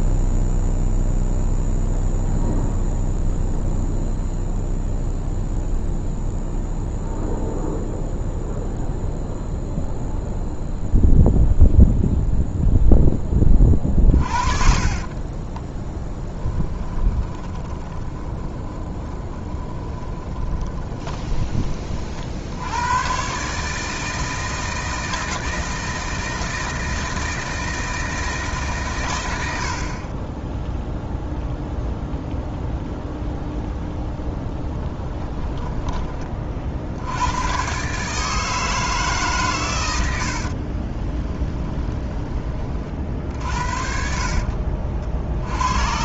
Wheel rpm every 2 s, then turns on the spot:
0, 0, 0, 0, 0, 0, 0, 40, 20, 20, 20, 80, 160, 160, 140, 0, 0, 10, 60, 160, 40, 30, 50.
14-22 34-36 40-42 44-46